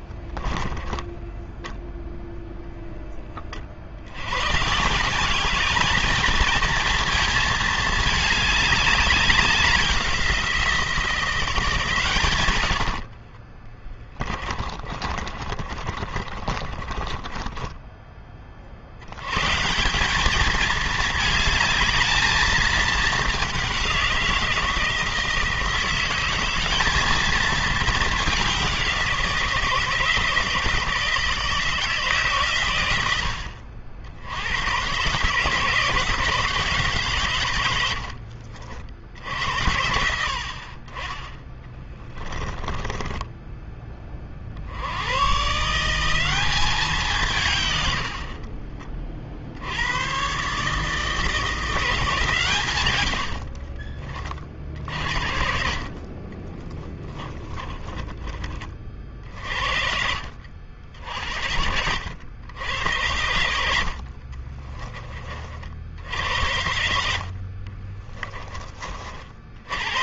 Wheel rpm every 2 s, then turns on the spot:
10, 10, 150, 220, 200, 170, 60, 30, 20, 70, 220, 210, 160, 200, 190, 160, 110, 120, 150, 60, 40, 10, 70, 180, 40, 150, 150, 70, 20, 30, 60, 90, 30, 70, 30.
0-2 12-18 42-44 52-54 56-60